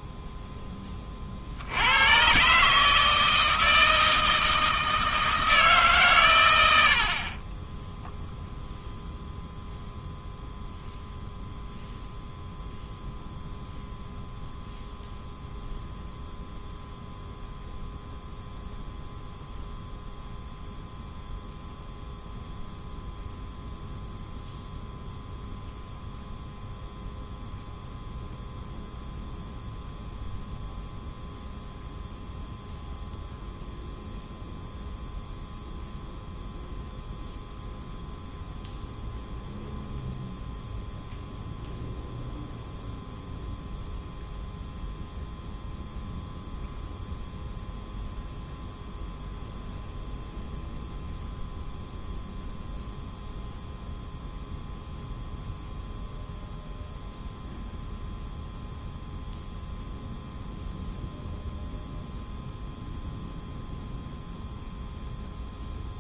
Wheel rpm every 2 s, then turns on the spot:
10, 140, 160, 100, 0, 0, 0, 0, 0, 0, 0, 0, 0, 0, 0, 0, 0, 0, 0, 0, 0, 0, 0, 0, 0, 0, 0, 0, 0, 0, 0, 0, 0.
none